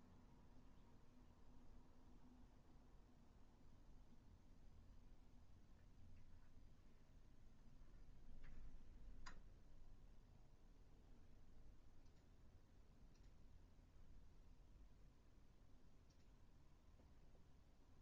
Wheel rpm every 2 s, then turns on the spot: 0, 0, 0, 0, 0, 0, 0, 0, 0.
none